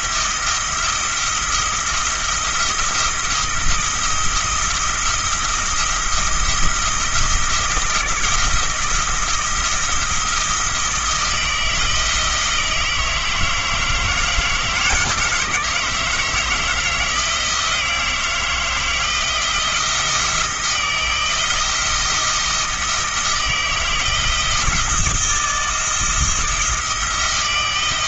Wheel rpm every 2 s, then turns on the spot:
170, 170, 170, 170, 170, 170, 160, 160, 160, 170, 170, 160, 170, 170.
none